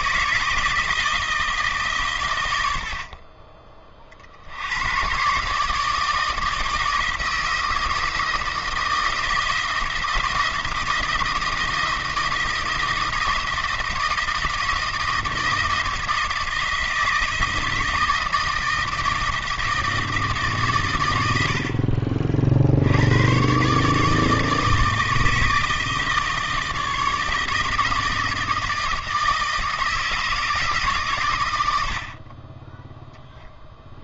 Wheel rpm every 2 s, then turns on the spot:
160, 70, 110, 170, 160, 160, 160, 170, 160, 160, 120, 80, 150, 160, 160, 140, 10.
none